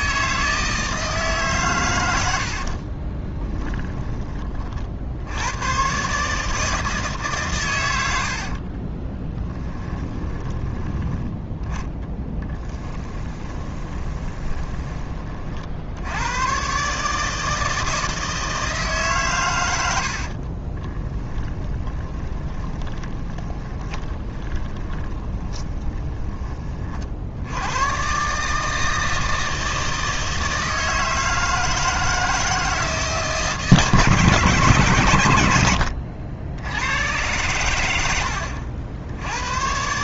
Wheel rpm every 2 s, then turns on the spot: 160, 60, 40, 160, 40, 20, 10, 20, 130, 160, 40, 20, 20, 40, 160, 160, 160, 130, 90, 70.
2-4 8-14 20-26